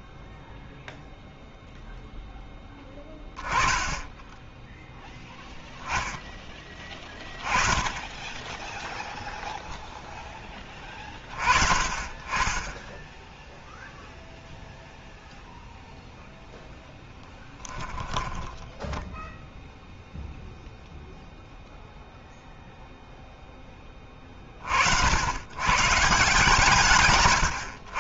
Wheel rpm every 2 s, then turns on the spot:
0, 10, 10, 10, 10, 10, 20, 0, 0, 10, 0, 0, 30, 140.
18-20